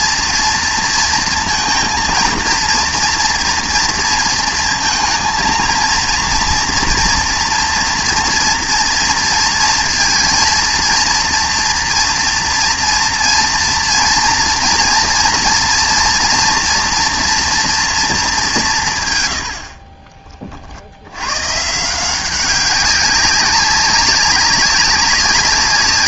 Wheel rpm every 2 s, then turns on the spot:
230, 230, 230, 230, 230, 230, 230, 230, 230, 170, 50, 190, 200.
none